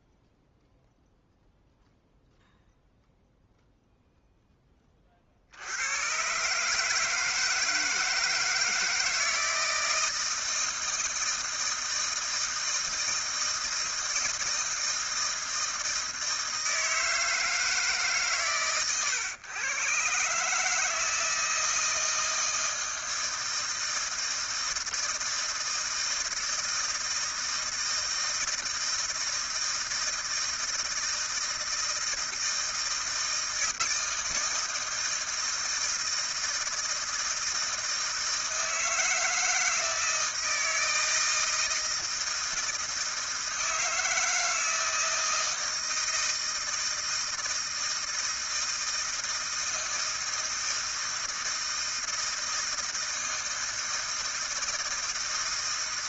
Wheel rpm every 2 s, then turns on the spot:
0, 0, 0, 120, 160, 160, 160, 160, 160, 130, 140, 160, 160, 160, 160, 160, 160, 160, 160, 160, 160, 160, 160, 160, 160, 160, 160, 160.
none